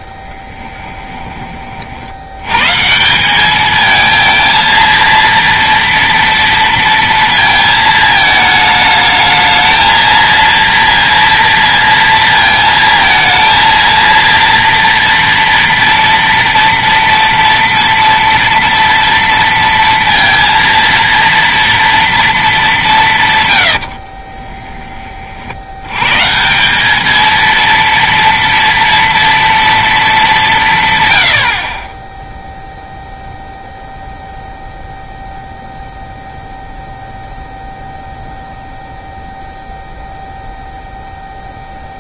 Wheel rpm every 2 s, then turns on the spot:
20, 130, 230, 230, 210, 230, 230, 230, 230, 230, 230, 210, 20, 180, 230, 170, 0, 0, 0, 0, 0.
0-2 24-26